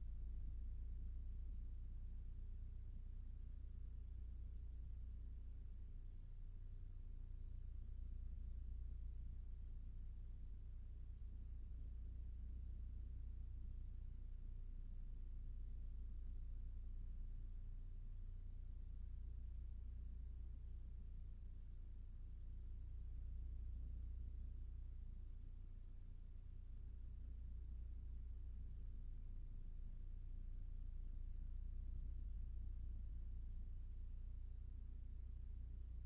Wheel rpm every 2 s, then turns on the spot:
0, 0, 0, 0, 0, 0, 0, 0, 0, 0, 0, 0, 0, 0, 0, 0, 0, 0.
none